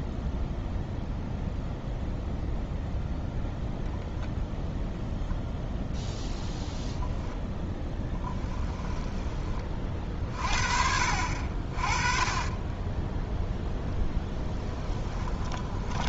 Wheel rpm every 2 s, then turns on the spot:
0, 0, 0, 0, 10, 50, 20, 10.
8-10 14-16